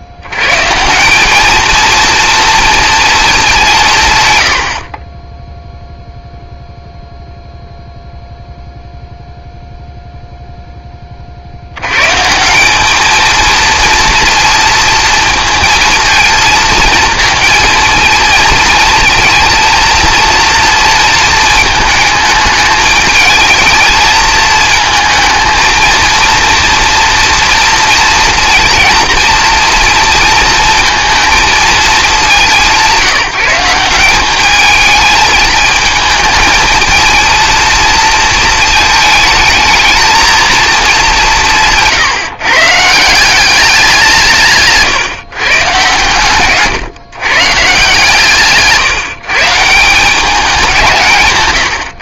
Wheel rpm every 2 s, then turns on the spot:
140, 240, 90, 0, 0, 0, 190, 230, 220, 230, 230, 210, 220, 240, 230, 230, 190, 220, 220, 220, 220, 140, 150, 140, 150, 190.
46-48